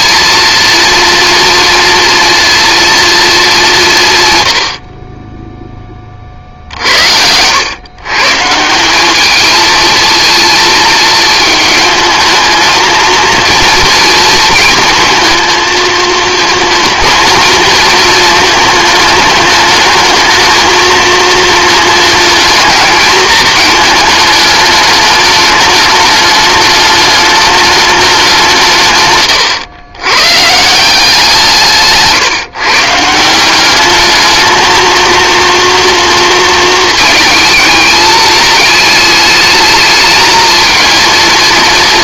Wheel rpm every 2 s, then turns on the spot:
230, 230, 50, 70, 190, 220, 220, 220, 220, 220, 220, 220, 210, 210, 130, 180, 150, 220, 220, 210, 220.
none